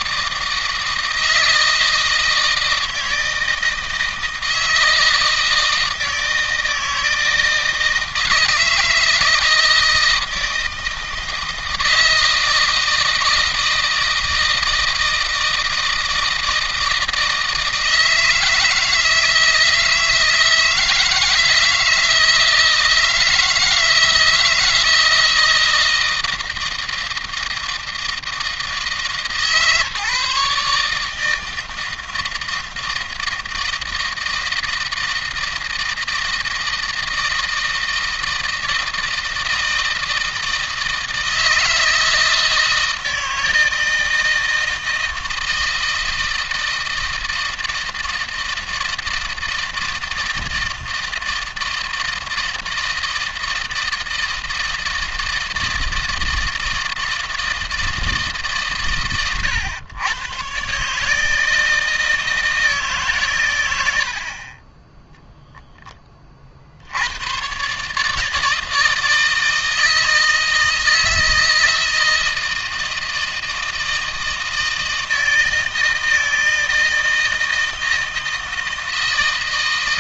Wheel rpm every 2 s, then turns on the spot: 160, 160, 160, 160, 160, 160, 160, 160, 160, 160, 160, 160, 160, 160, 160, 150, 160, 160, 160, 160, 160, 160, 160, 160, 160, 160, 160, 160, 160, 130, 130, 160, 40, 40, 160, 160, 160, 160, 160, 160.
none